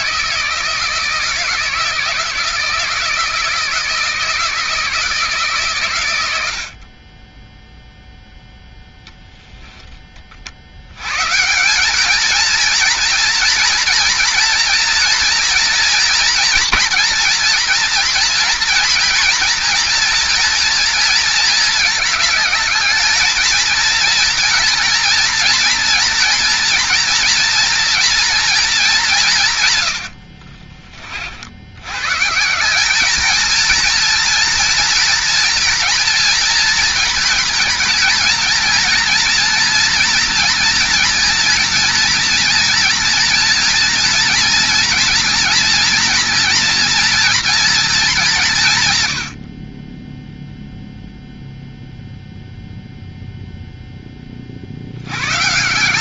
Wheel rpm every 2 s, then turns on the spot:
160, 160, 160, 80, 0, 50, 230, 230, 230, 230, 230, 220, 240, 230, 220, 40, 180, 230, 230, 230, 230, 230, 230, 230, 170, 0, 0, 40.
30-32